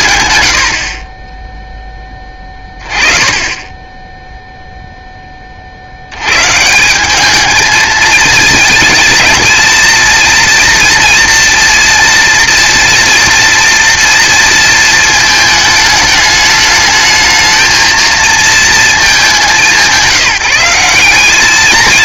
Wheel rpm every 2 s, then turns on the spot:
60, 20, 0, 180, 220, 230, 230, 220, 210, 220, 180.
none